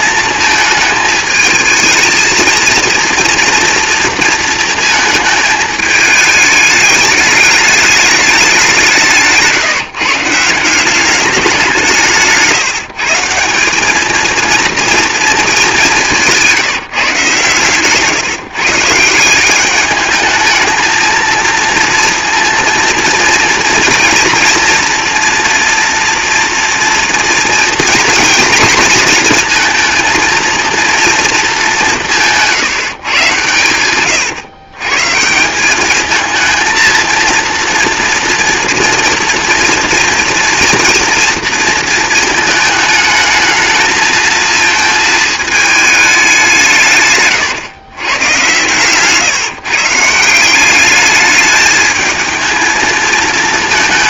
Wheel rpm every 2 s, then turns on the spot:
220, 230, 230, 210, 190, 170, 160, 230, 160, 150, 220, 230, 230, 230, 230, 230, 170, 130, 230, 230, 230, 220, 220, 160, 130, 190, 220.
16-18 48-50